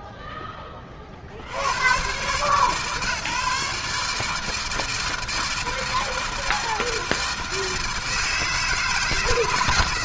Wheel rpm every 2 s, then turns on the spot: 60, 150, 160, 160, 160.
none